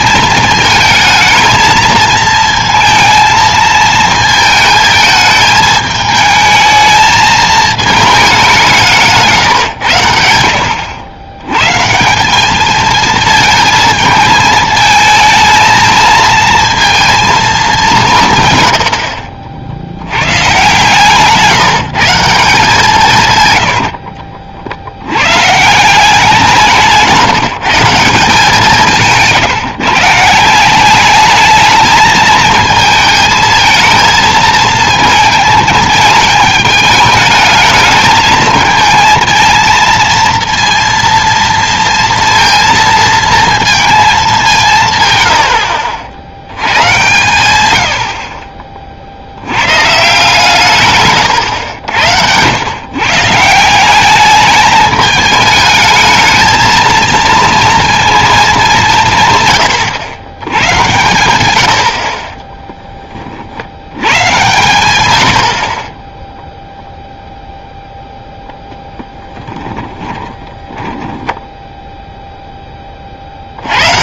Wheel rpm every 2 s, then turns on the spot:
220, 220, 220, 220, 190, 80, 210, 220, 230, 110, 120, 170, 60, 160, 170, 170, 220, 220, 210, 220, 230, 230, 180, 100, 40, 150, 110, 210, 220, 200, 110, 20, 120, 0, 0, 20, 10.
70-72